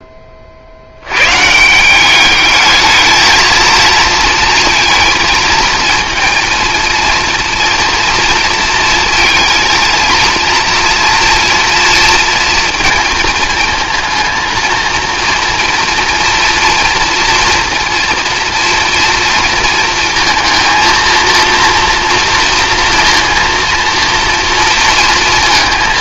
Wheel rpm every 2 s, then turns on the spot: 80, 220, 220, 230, 230, 230, 230, 230, 230, 230, 230, 230, 230.
none